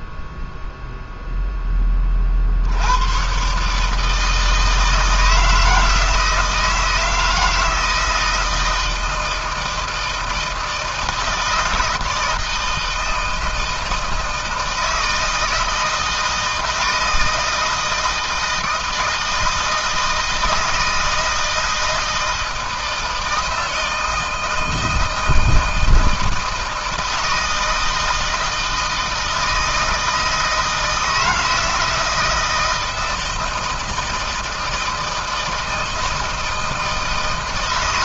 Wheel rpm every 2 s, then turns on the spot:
0, 80, 160, 160, 160, 160, 160, 160, 160, 160, 160, 160, 160, 160, 160, 160, 170, 160, 160.
none